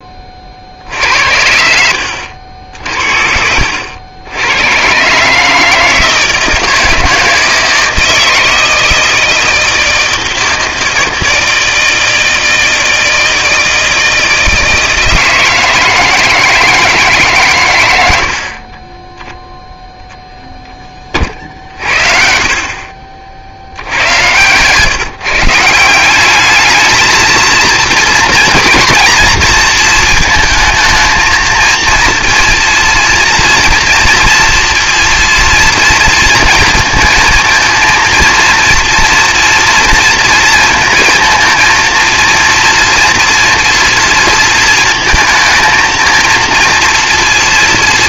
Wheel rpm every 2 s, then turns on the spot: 60, 60, 110, 160, 160, 160, 160, 160, 160, 30, 10, 50, 130, 220, 240, 220, 230, 230, 230, 230, 230, 230, 230, 230.
18-20